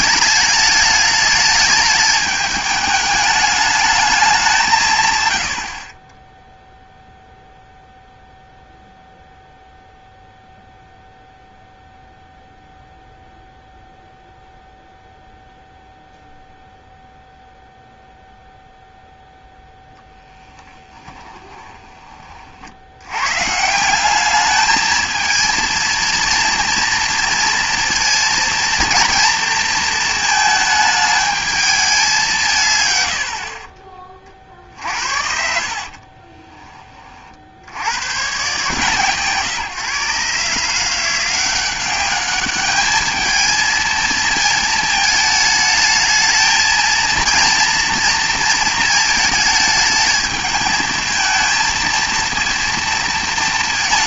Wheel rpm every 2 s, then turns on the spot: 210, 210, 170, 0, 0, 0, 0, 0, 0, 0, 20, 60, 210, 230, 230, 220, 130, 60, 30, 140, 160, 210, 220, 220, 230, 220, 230.
20-22